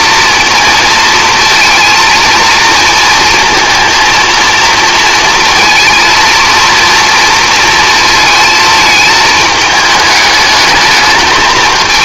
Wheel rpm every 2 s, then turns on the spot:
230, 230, 230, 230, 220, 220.
none